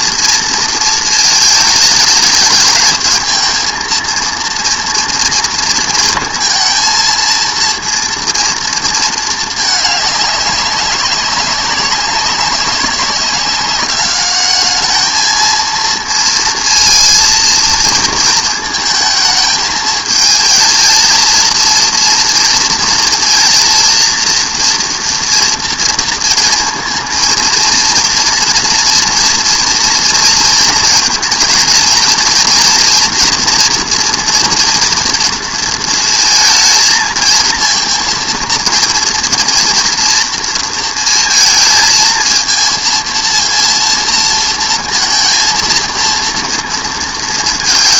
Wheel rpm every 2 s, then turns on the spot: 230, 220, 230, 230, 230, 200, 200, 210, 230, 220, 230, 230, 230, 230, 230, 230, 230, 230, 220, 230, 230, 230, 230, 230.
none